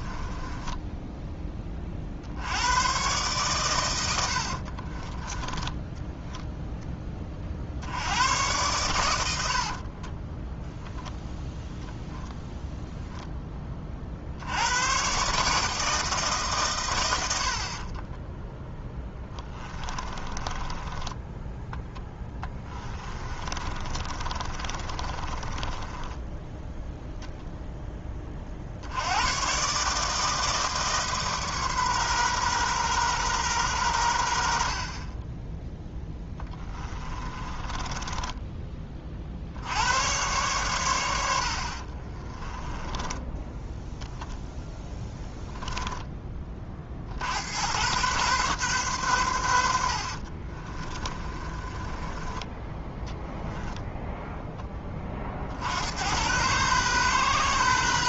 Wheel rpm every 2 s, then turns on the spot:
10, 110, 50, 0, 110, 0, 0, 100, 120, 10, 20, 20, 30, 0, 60, 150, 130, 60, 20, 20, 110, 10, 0, 40, 120, 30, 10, 20, 120.
0-2 4-6 20-26 36-38 42-44 50-52